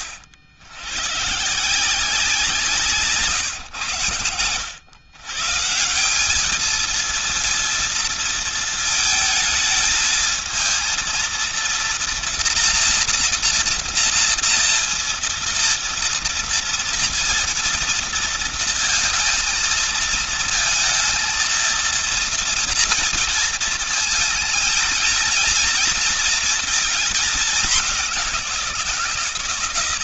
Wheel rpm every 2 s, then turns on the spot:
100, 170, 100, 220, 230, 230, 240, 230, 230, 230, 230, 230, 220, 220, 170.
none